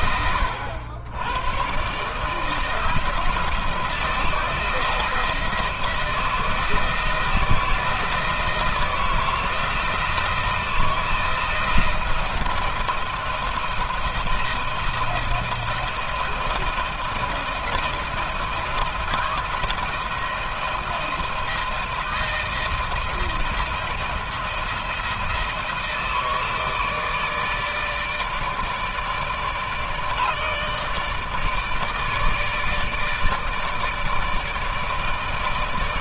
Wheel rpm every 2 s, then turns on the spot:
90, 160, 160, 160, 160, 170, 170, 170, 170, 170, 160, 160, 160, 160, 160, 150, 160, 160.
none